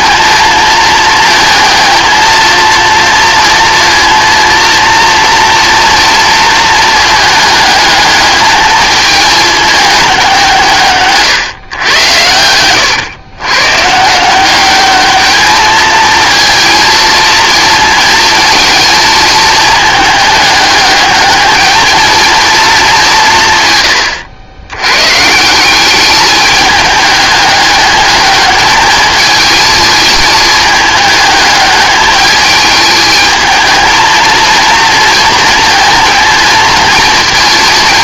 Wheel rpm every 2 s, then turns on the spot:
220, 230, 230, 230, 220, 170, 110, 200, 220, 220, 210, 210, 100, 210, 210, 220, 210, 230, 220.
none